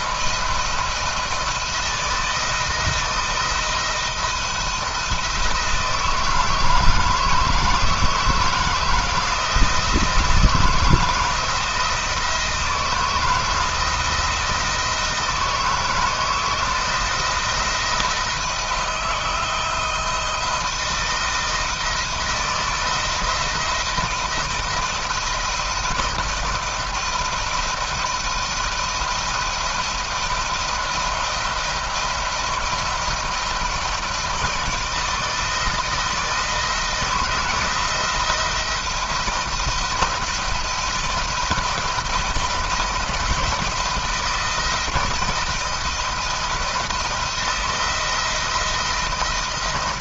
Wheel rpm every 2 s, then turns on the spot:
160, 160, 170, 160, 160, 170, 160, 160, 170, 160, 160, 170, 170, 160, 160, 160, 160, 160, 170, 170, 170, 170, 160, 160, 170.
none